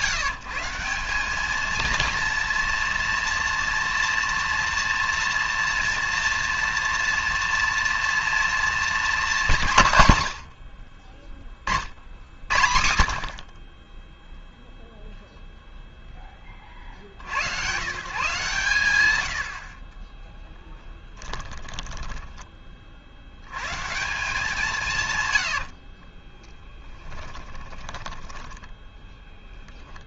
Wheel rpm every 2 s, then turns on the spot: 180, 230, 230, 230, 230, 90, 70, 0, 40, 100, 20, 40, 170, 10, 20.
20-22 26-30